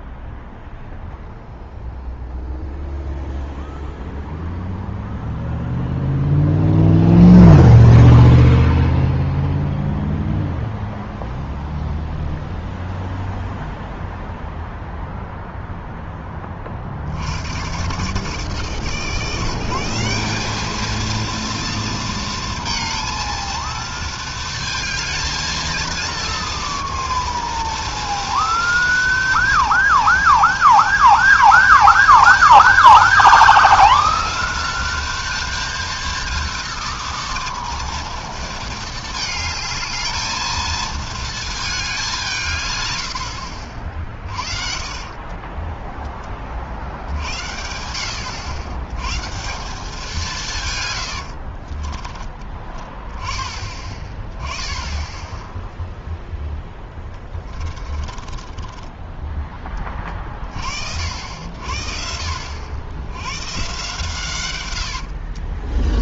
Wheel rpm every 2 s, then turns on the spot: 0, 0, 0, 0, 0, 0, 0, 0, 90, 170, 230, 230, 220, 230, 230, 230, 230, 230, 230, 220, 220, 70, 30, 70, 160, 90, 10, 0, 20, 10, 60, 110, 50.
44-46 50-52 56-60 64-66